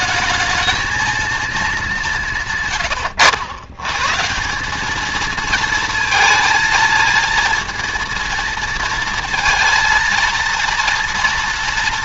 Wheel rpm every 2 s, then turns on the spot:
220, 100, 210, 230, 230, 230.
none